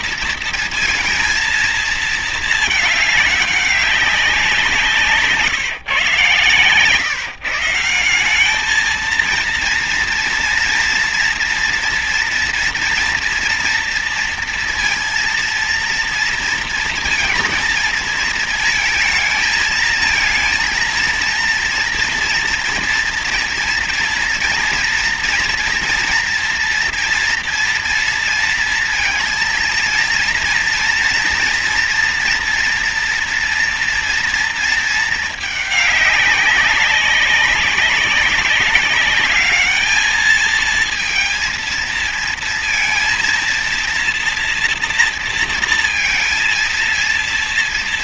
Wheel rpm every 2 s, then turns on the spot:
230, 220, 180, 140, 190, 230, 230, 230, 230, 220, 230, 240, 230, 230, 230, 230, 240, 230, 200, 190, 220, 230, 240, 230.
none